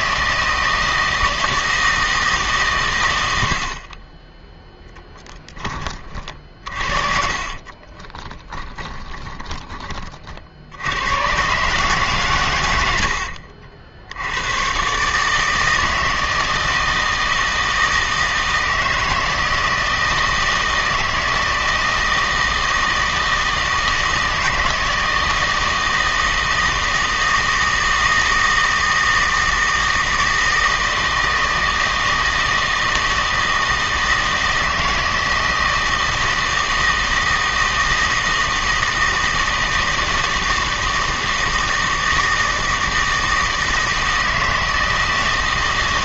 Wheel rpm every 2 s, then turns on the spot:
160, 130, 0, 40, 10, 70, 100, 130, 160, 160, 160, 160, 160, 160, 160, 160, 160, 160, 160, 160, 160, 160, 160.
6-10